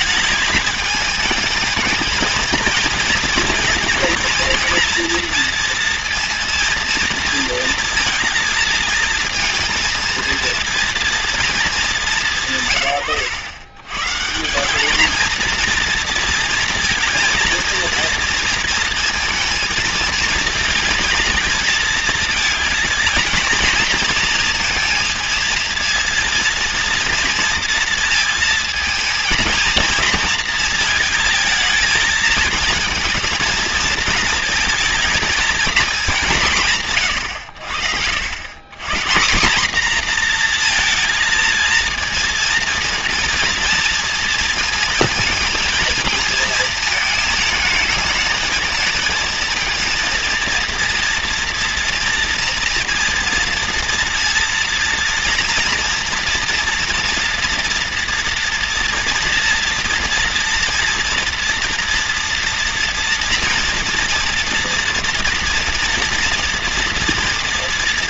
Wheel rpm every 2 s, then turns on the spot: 210, 230, 240, 230, 230, 230, 130, 200, 230, 230, 230, 220, 230, 230, 220, 220, 220, 230, 140, 140, 230, 230, 230, 220, 220, 230, 230, 230, 230, 230, 230, 230, 230, 230.
none